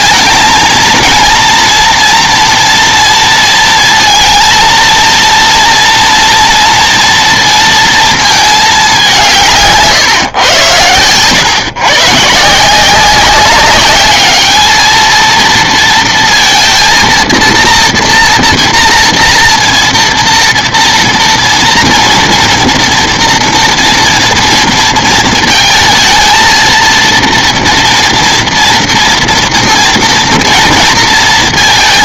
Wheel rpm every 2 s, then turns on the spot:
220, 230, 230, 230, 210, 110, 170, 220, 230, 240, 230, 230, 230, 230, 230, 230.
none